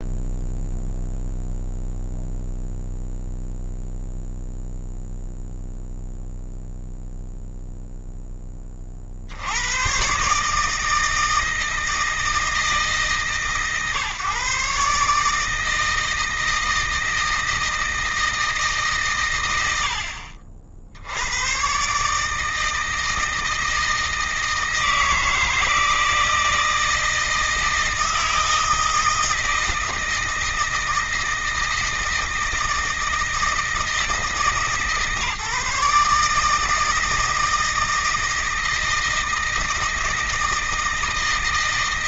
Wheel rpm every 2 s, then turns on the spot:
0, 0, 0, 0, 30, 160, 160, 150, 160, 150, 70, 160, 160, 160, 160, 160, 160, 150, 160, 160, 160.
none